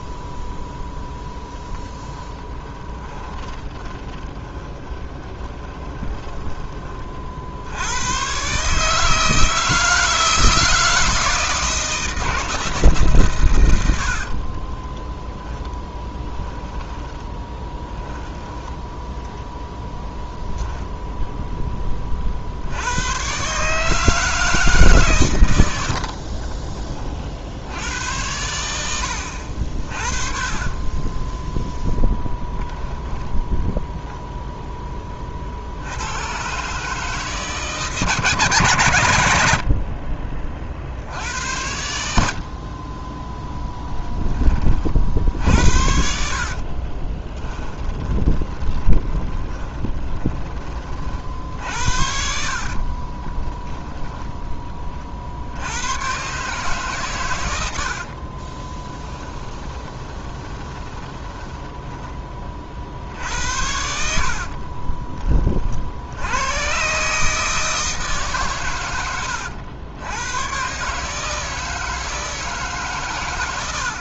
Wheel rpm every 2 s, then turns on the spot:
0, 20, 20, 30, 150, 160, 150, 30, 10, 10, 0, 100, 140, 30, 90, 20, 10, 20, 150, 110, 60, 30, 40, 40, 20, 40, 40, 30, 140, 10, 20, 50, 30, 140, 120, 140, 130.
2-6 14-18 30-32 46-50 52-54 58-62 64-66